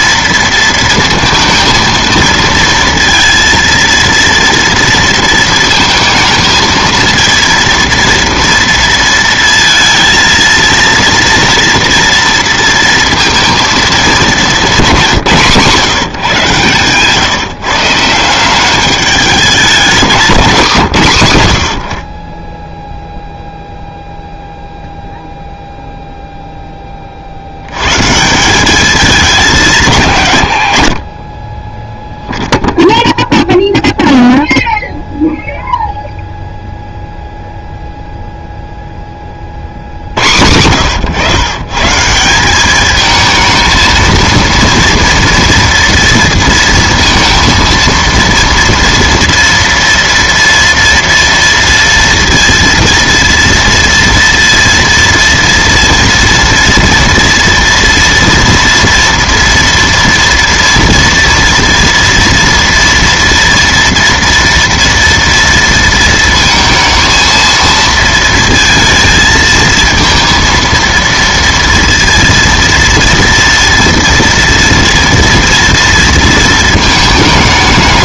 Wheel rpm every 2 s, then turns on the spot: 230, 230, 230, 220, 230, 230, 230, 200, 140, 190, 170, 10, 0, 10, 200, 70, 0, 0, 0, 0, 100, 200, 230, 230, 230, 230, 230, 230, 230, 230, 230, 230, 230, 220, 230, 230, 230, 230, 220.
20-22